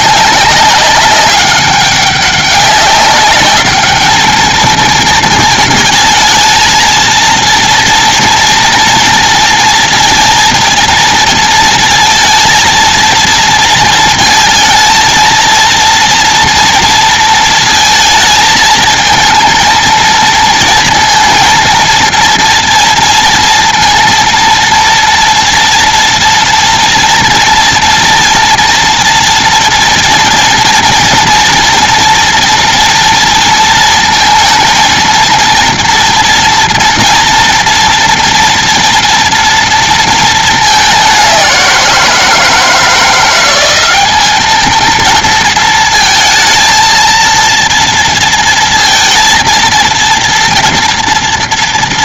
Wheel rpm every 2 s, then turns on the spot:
200, 200, 220, 230, 230, 220, 220, 230, 230, 220, 230, 230, 230, 230, 240, 230, 230, 230, 230, 230, 200, 170, 220, 230, 230, 230.
none